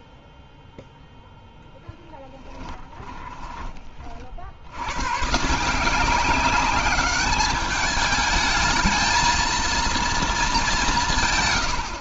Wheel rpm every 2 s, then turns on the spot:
0, 20, 100, 190, 220, 200.
2-4